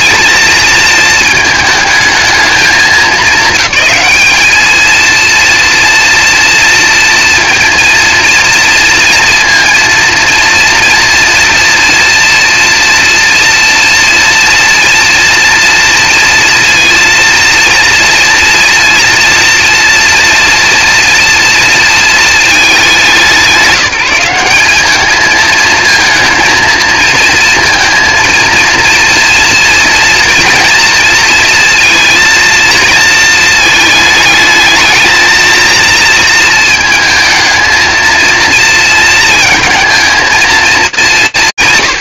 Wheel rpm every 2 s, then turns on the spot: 220, 200, 220, 230, 230, 240, 240, 230, 230, 230, 230, 190, 220, 230, 230, 230, 220, 220, 220, 230, 180.
none